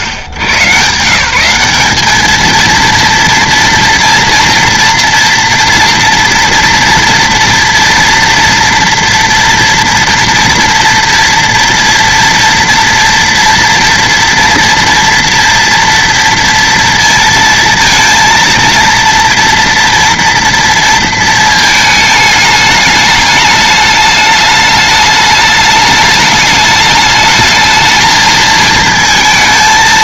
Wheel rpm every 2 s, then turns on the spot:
120, 210, 230, 230, 240, 240, 230, 230, 230, 230, 230, 210, 210, 210, 220.
none